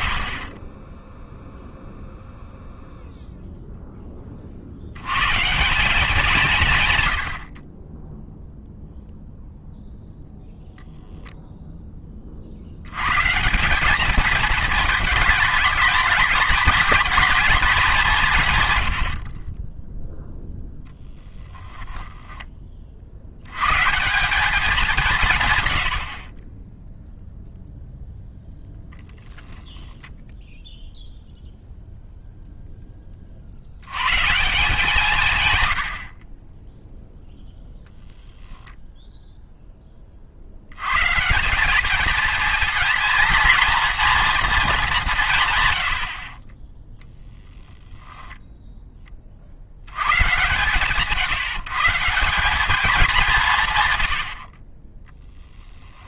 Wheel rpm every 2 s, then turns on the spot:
50, 0, 40, 170, 0, 0, 60, 220, 220, 150, 0, 20, 200, 30, 0, 0, 0, 170, 20, 0, 70, 220, 220, 30, 0, 120, 200, 60.
none